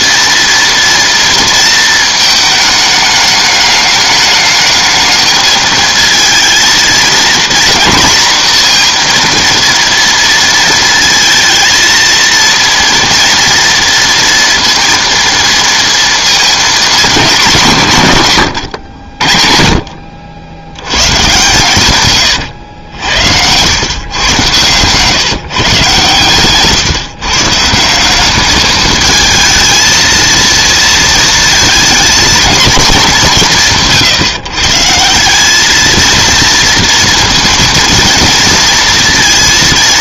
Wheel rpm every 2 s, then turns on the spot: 230, 210, 210, 230, 230, 220, 230, 230, 230, 90, 100, 90, 130, 140, 220, 230, 220, 150, 230, 230.
18-20 22-24